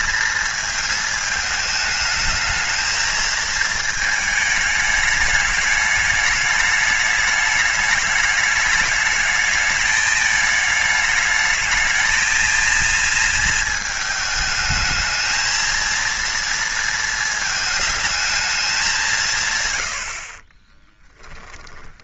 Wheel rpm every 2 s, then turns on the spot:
220, 220, 210, 210, 210, 210, 230, 220, 230, 200, 20.
20-22